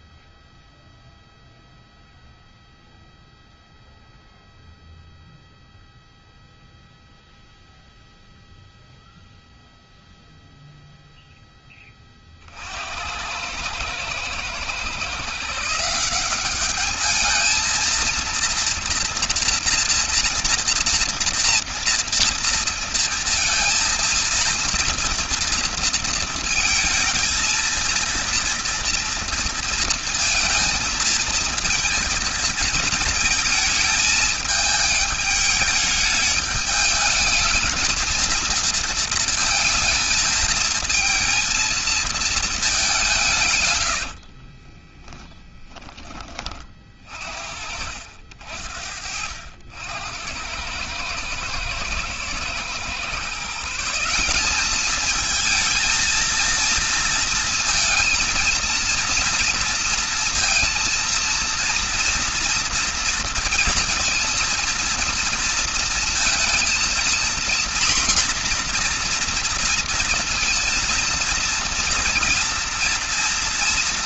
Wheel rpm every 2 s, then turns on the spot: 0, 0, 0, 0, 0, 0, 80, 140, 210, 240, 240, 230, 230, 220, 230, 230, 220, 210, 210, 220, 220, 180, 20, 50, 80, 100, 140, 210, 230, 230, 230, 230, 230, 230, 240, 230, 230.
44-46